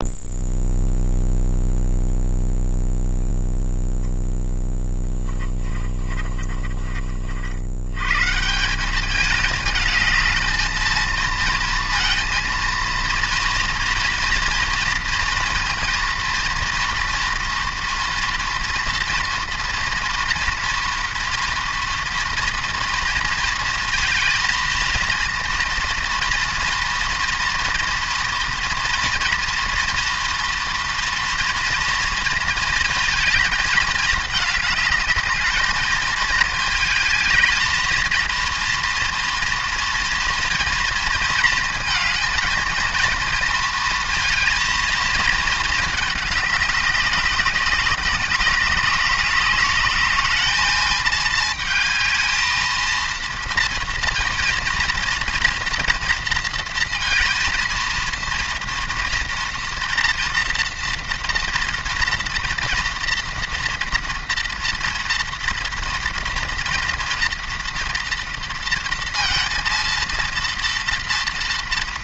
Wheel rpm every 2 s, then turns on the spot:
0, 0, 0, 30, 180, 230, 230, 230, 230, 230, 240, 230, 230, 240, 230, 230, 220, 210, 220, 230, 230, 230, 230, 200, 190, 210, 220, 230, 230, 230, 230, 230, 230, 230, 230, 230.
6-8